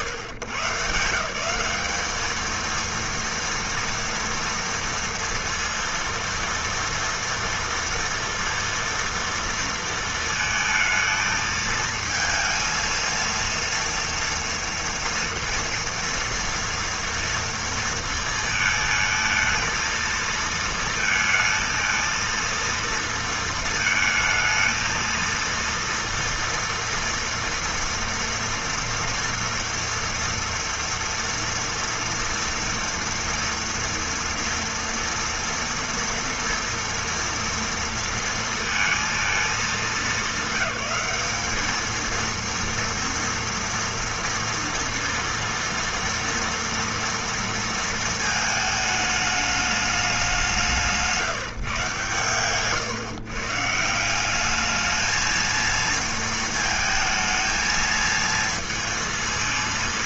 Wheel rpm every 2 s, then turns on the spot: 150, 220, 240, 230, 230, 220, 230, 230, 230, 230, 220, 230, 220, 230, 230, 230, 230, 240, 230, 230, 200, 230, 230, 230, 220, 180, 130, 200, 230, 230.
none